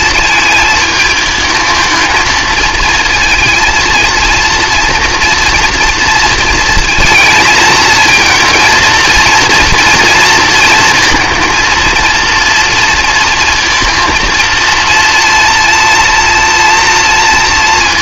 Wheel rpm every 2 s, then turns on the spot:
220, 230, 230, 230, 230, 230, 230, 230, 230.
none